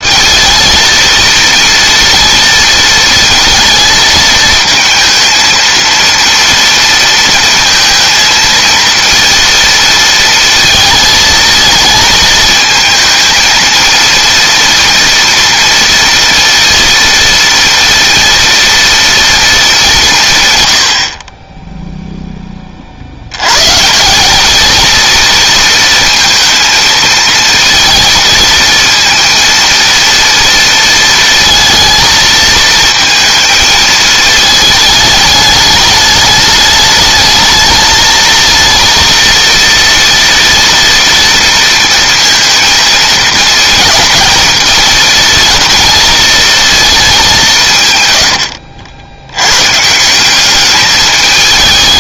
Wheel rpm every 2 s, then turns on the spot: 220, 220, 220, 230, 230, 220, 220, 230, 230, 230, 90, 40, 220, 220, 230, 230, 220, 210, 210, 230, 230, 220, 220, 220, 80, 210.
none